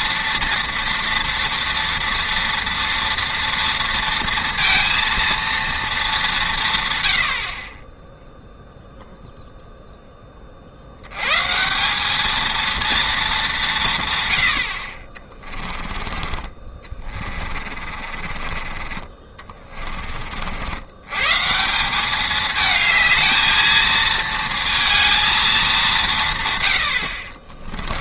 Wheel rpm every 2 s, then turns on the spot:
230, 230, 230, 140, 0, 50, 230, 80, 30, 40, 90, 220, 230, 120.
16-20